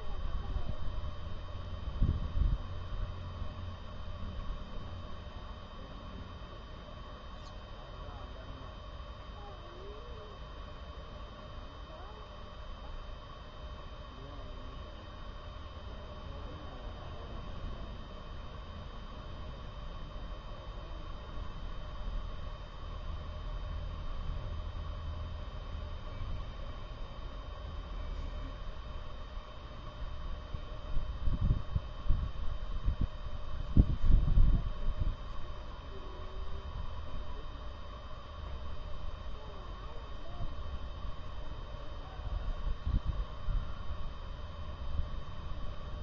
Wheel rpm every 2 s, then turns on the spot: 0, 0, 0, 0, 0, 0, 0, 0, 0, 0, 0, 0, 0, 0, 0, 0, 0, 0, 0, 0, 0, 0, 0.
none